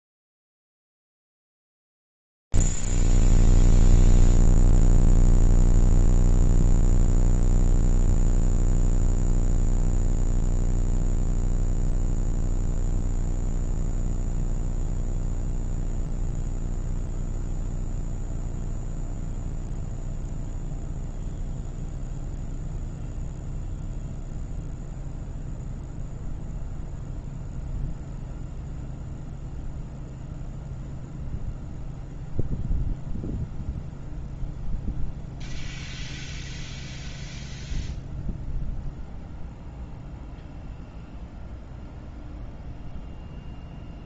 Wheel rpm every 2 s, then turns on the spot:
0, 0, 0, 0, 0, 0, 0, 0, 0, 0, 0, 0, 0, 0, 0, 0, 0, 0, 0, 0, 0, 0.
none